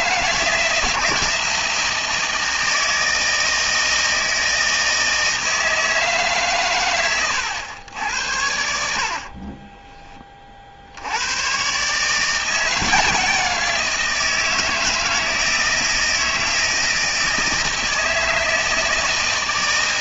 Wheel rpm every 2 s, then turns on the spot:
160, 160, 160, 130, 80, 50, 170, 160, 160, 160.
none